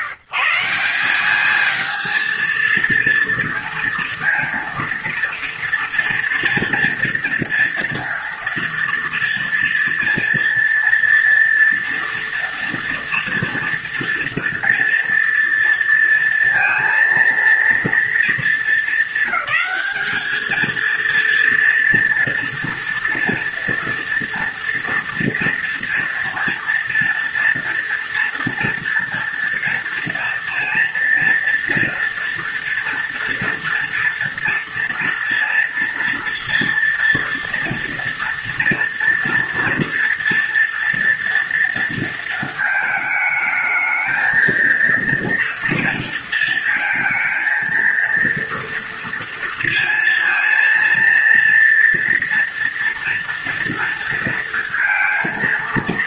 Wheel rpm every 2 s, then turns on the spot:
150, 230, 230, 230, 230, 230, 230, 240, 230, 230, 220, 230, 230, 230, 230, 230, 230, 230, 230, 230, 230, 230, 220, 230, 230, 230, 230, 230.
none